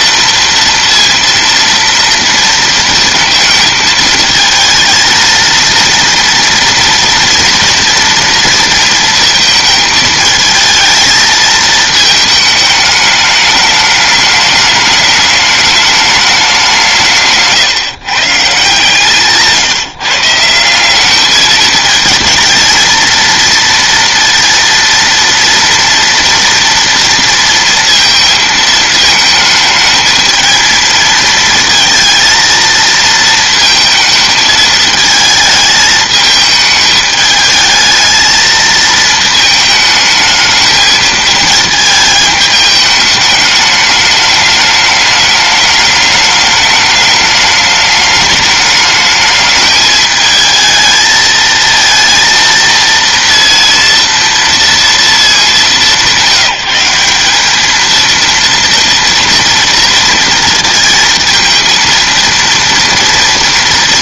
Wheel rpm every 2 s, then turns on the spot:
230, 230, 220, 230, 230, 220, 210, 210, 190, 150, 170, 230, 230, 230, 220, 220, 230, 220, 220, 220, 220, 210, 210, 210, 210, 220, 230, 230, 180, 230, 230, 230.
none